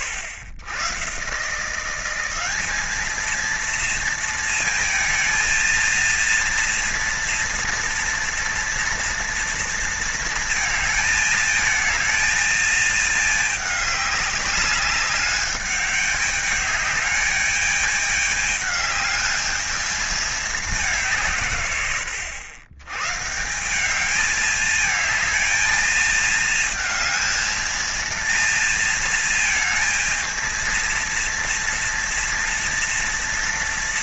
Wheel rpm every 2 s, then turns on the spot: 100, 210, 230, 230, 240, 220, 220, 200, 210, 210, 200, 110, 220, 220, 230, 230, 230.
none